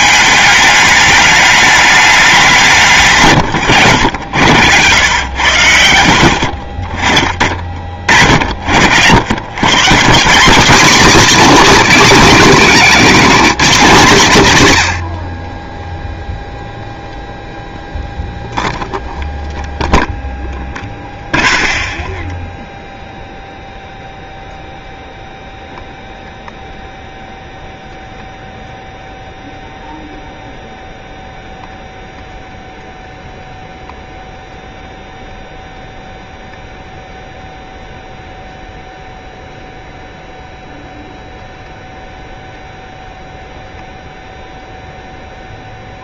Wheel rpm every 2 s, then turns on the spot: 210, 170, 100, 40, 70, 220, 220, 100, 0, 0, 0, 0, 0, 0, 0, 0, 0, 0, 0, 0, 0, 0, 0.
none